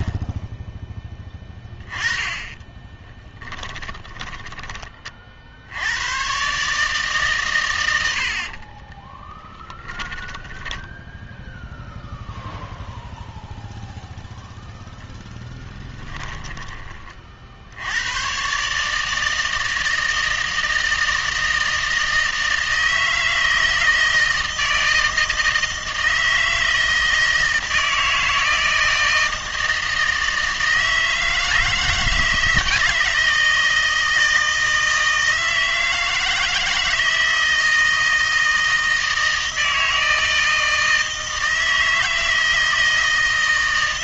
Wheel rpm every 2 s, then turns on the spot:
10, 10, 20, 140, 40, 10, 0, 0, 30, 140, 160, 160, 160, 160, 160, 160, 160, 160, 160, 160, 160, 160.
2-4 8-12